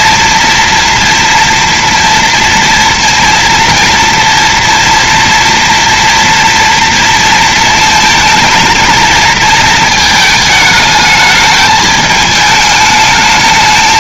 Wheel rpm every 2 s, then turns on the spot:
230, 230, 230, 230, 230, 220, 220.
none